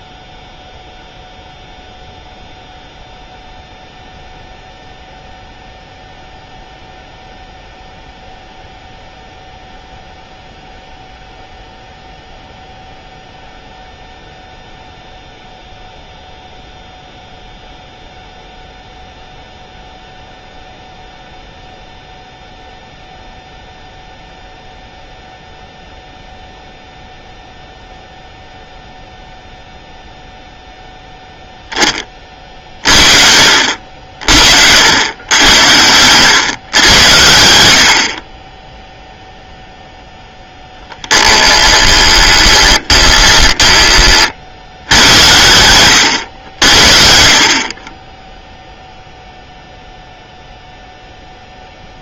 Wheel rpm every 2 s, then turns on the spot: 0, 0, 0, 0, 0, 0, 0, 0, 0, 0, 0, 0, 0, 0, 0, 0, 50, 80, 110, 10, 10, 20, 90, 70, 0, 0.
40-44